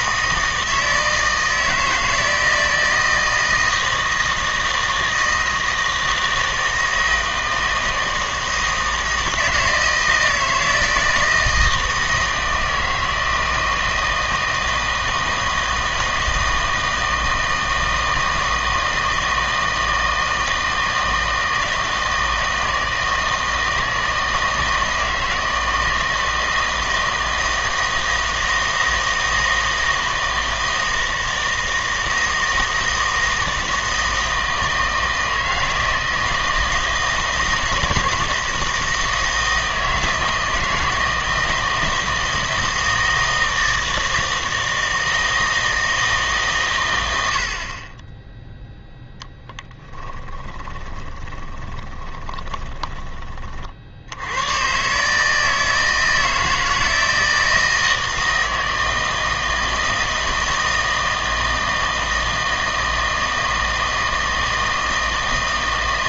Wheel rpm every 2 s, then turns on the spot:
160, 160, 160, 160, 160, 160, 160, 160, 160, 160, 160, 160, 160, 160, 160, 160, 160, 160, 160, 160, 160, 160, 160, 120, 0, 20, 20, 120, 160, 160, 160, 160, 160.
50-54